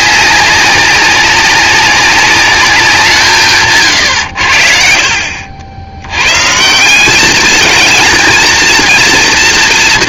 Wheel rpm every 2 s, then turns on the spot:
190, 170, 60, 180, 230.
none